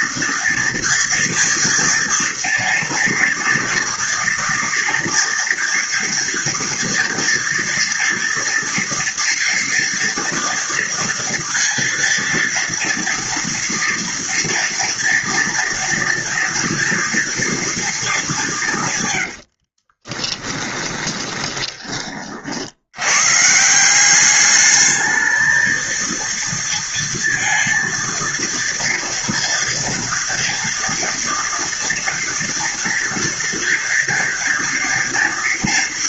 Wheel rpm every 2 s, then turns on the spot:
230, 230, 230, 230, 230, 230, 230, 230, 230, 170, 20, 60, 210, 230, 230, 230, 230, 230.
20-22